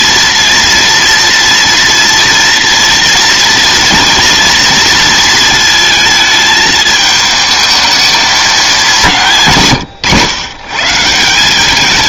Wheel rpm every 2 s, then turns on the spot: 240, 230, 230, 220, 190, 140.
none